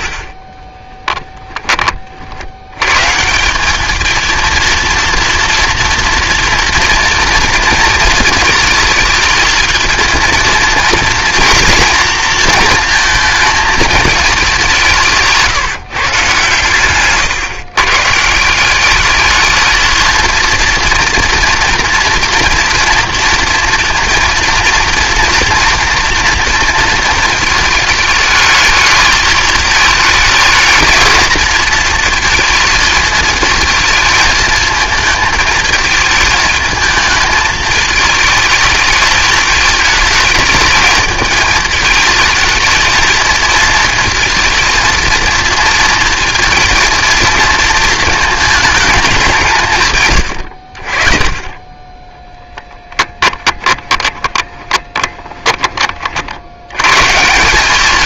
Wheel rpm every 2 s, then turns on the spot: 10, 100, 230, 230, 220, 230, 230, 170, 140, 200, 230, 230, 230, 220, 210, 220, 220, 220, 220, 220, 220, 220, 230, 230, 210, 50, 10, 20, 120.
0-2 52-56